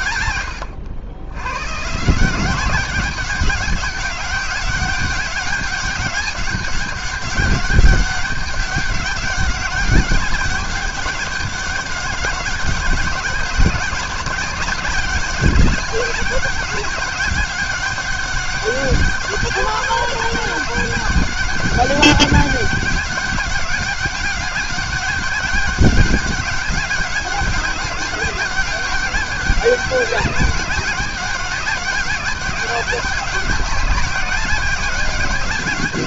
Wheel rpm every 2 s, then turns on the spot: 100, 200, 200, 200, 190, 190, 200, 200, 200, 200, 200, 200, 200, 200, 200, 200, 190, 200.
none